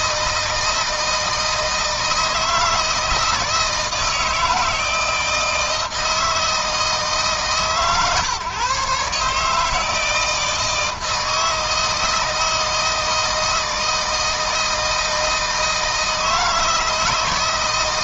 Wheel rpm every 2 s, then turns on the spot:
160, 160, 160, 160, 150, 160, 160, 160, 160.
none